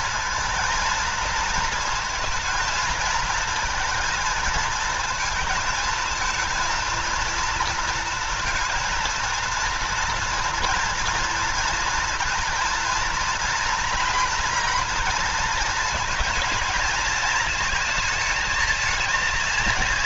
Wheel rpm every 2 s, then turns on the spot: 230, 220, 220, 230, 230, 230, 240, 230, 220, 220.
none